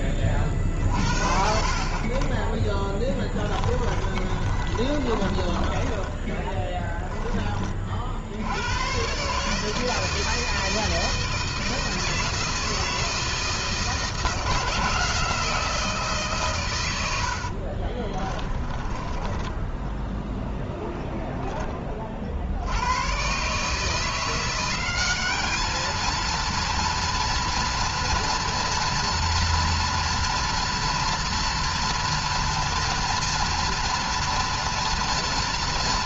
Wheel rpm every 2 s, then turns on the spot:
30, 10, 30, 10, 100, 160, 160, 160, 120, 20, 0, 80, 190, 230, 240, 240, 240, 230.
4-8 18-20